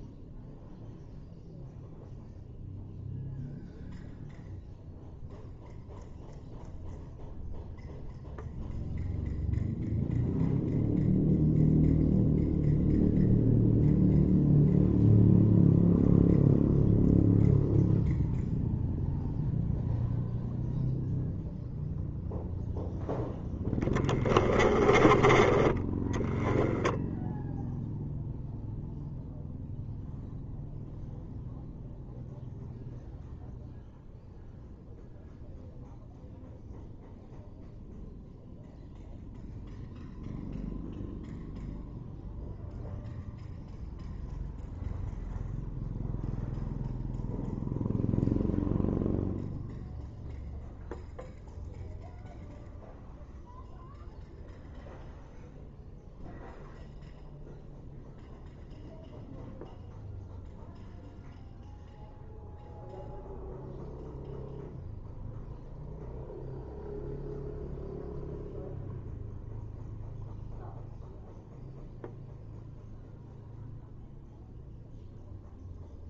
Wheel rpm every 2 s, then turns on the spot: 0, 0, 0, 0, 0, 0, 0, 0, 0, 0, 0, 0, 20, 10, 0, 0, 0, 0, 0, 0, 0, 0, 0, 0, 0, 0, 0, 0, 0, 0, 0, 0, 0, 0, 0, 0, 0, 0.
24-26